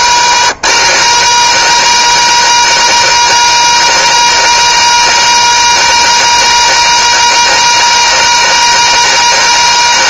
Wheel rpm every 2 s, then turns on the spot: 210, 220, 220, 220, 220.
none